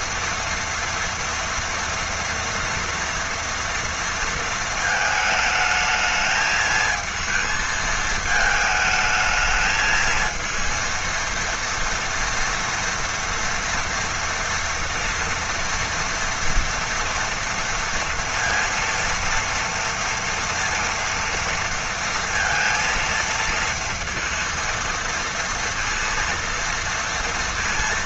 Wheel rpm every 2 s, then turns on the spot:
230, 230, 230, 220, 220, 230, 230, 230, 230, 230, 230, 230, 230, 230.
none